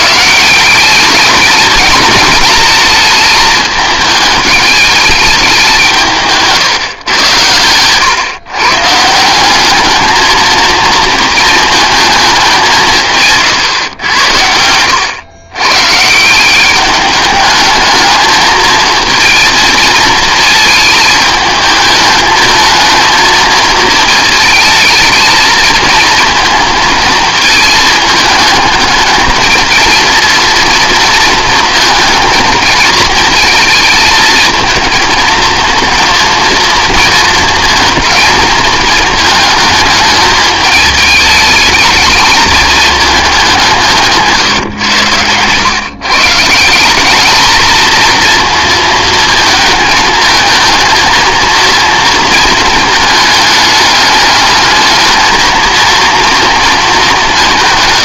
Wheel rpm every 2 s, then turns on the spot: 190, 220, 210, 140, 140, 220, 180, 90, 200, 220, 220, 220, 220, 230, 220, 230, 220, 220, 230, 220, 210, 220, 110, 190, 230, 230, 220, 220, 220.
none